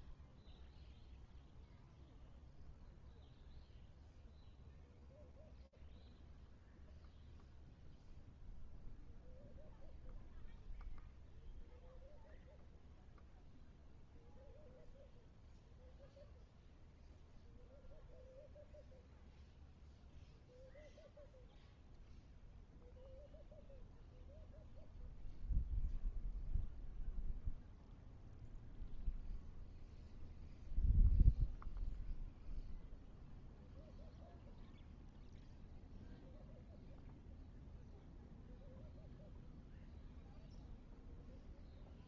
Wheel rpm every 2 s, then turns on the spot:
0, 0, 0, 0, 0, 0, 0, 0, 0, 0, 0, 0, 0, 0, 0, 0, 0, 0, 0, 0, 0.
none